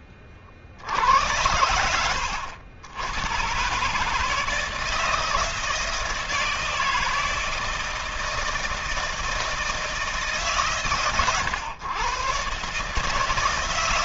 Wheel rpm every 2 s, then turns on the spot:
70, 100, 160, 160, 160, 130, 140.
none